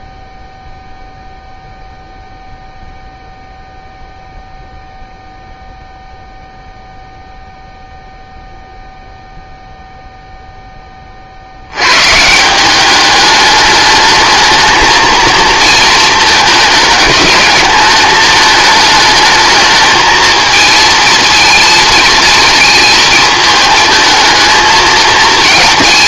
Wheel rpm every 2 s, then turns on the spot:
0, 0, 0, 0, 0, 10, 190, 220, 210, 220, 230, 220, 220.
none